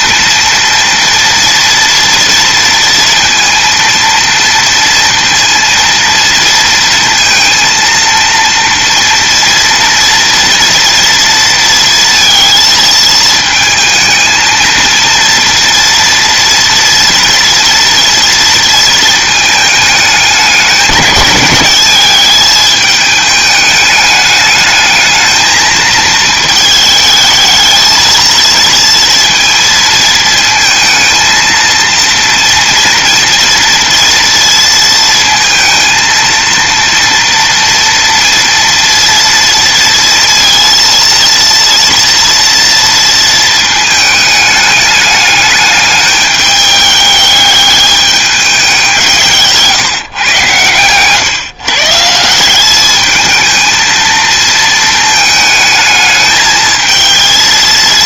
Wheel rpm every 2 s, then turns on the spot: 230, 230, 230, 230, 230, 230, 230, 220, 230, 220, 210, 210, 210, 220, 230, 220, 230, 230, 230, 230, 230, 230, 210, 210, 190, 120, 200, 220, 220.
none